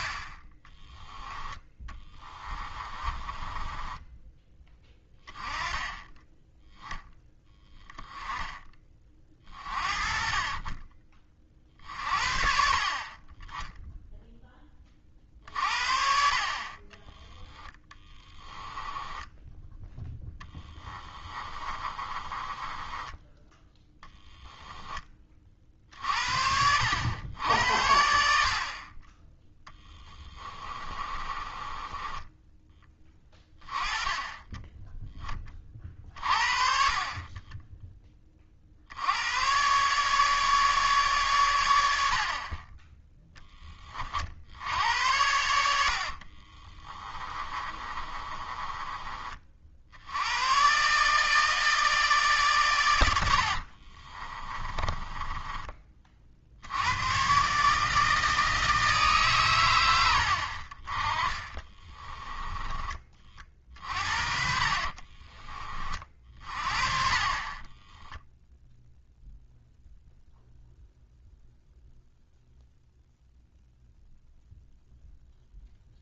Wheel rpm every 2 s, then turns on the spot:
10, 20, 10, 10, 20, 30, 40, 30, 30, 10, 10, 20, 10, 80, 30, 20, 10, 10, 40, 60, 140, 20, 80, 30, 30, 130, 120, 20, 90, 160, 40, 20, 40, 40, 0, 0, 0, 0.
2-4 18-24 30-32 46-50 54-56 64-66